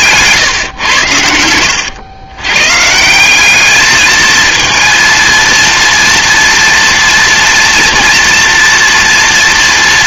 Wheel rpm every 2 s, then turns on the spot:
120, 140, 230, 230, 230.
none